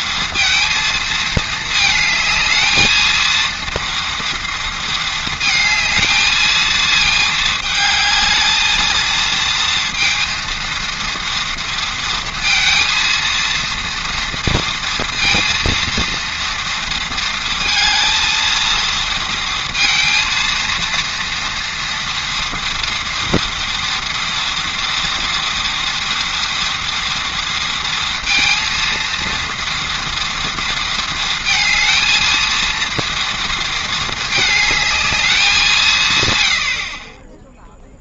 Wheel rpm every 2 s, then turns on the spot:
230, 220, 230, 220, 220, 230, 230, 230, 230, 230, 230, 230, 230, 230, 230, 230, 230, 220, 60.
none